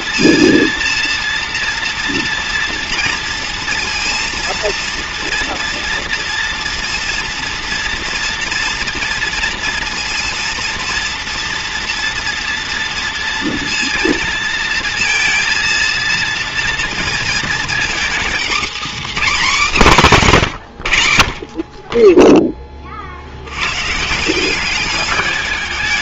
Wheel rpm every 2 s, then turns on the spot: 230, 230, 230, 230, 240, 230, 240, 230, 230, 260, 150, 10, 180.
none